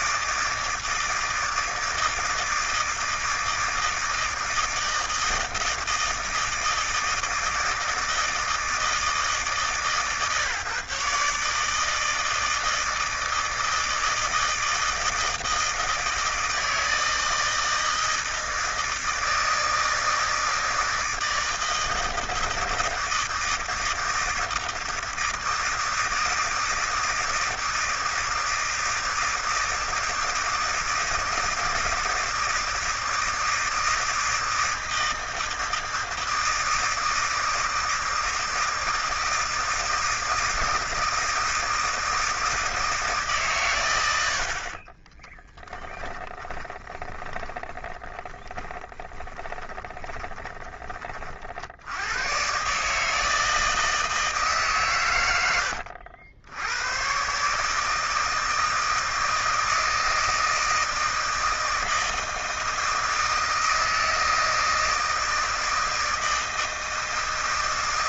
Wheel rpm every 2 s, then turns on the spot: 160, 160, 160, 160, 160, 140, 160, 160, 160, 160, 160, 160, 160, 160, 160, 160, 160, 160, 160, 160, 160, 160, 70, 20, 10, 20, 120, 150, 80, 160, 160, 160, 160, 160.
46-52